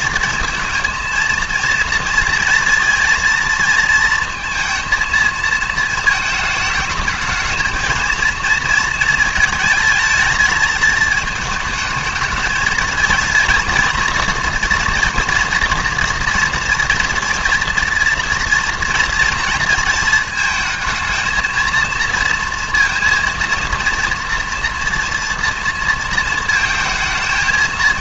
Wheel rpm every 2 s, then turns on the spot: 220, 230, 230, 220, 230, 220, 220, 230, 230, 240, 220, 230, 230, 230.
none